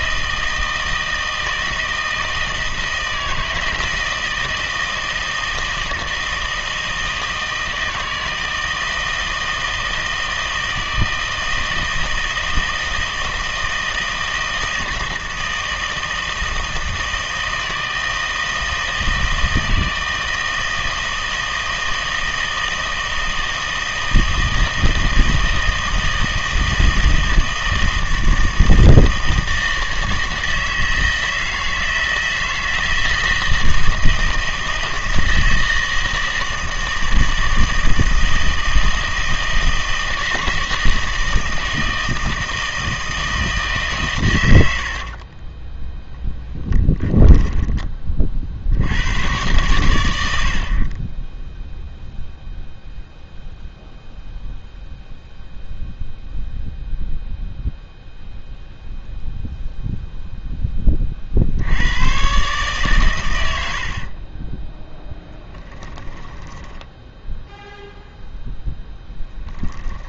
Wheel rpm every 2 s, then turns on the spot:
160, 160, 160, 160, 160, 160, 160, 160, 160, 160, 160, 160, 160, 160, 160, 160, 160, 160, 160, 160, 160, 160, 80, 10, 70, 60, 0, 0, 0, 0, 10, 130, 10, 10, 0.
44-48 64-68